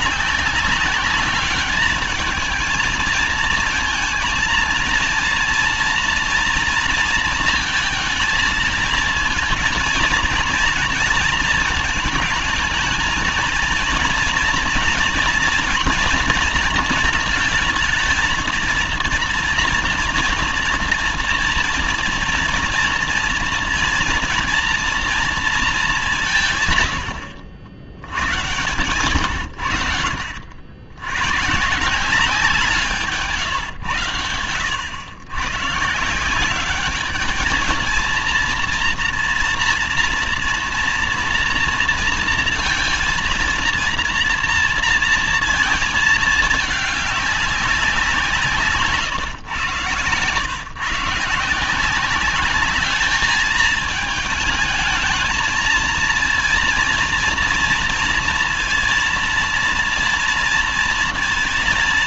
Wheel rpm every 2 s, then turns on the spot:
190, 220, 220, 230, 220, 230, 220, 230, 230, 230, 230, 240, 240, 160, 120, 80, 170, 90, 190, 230, 230, 230, 230, 220, 160, 110, 200, 220, 230, 230, 230.
48-50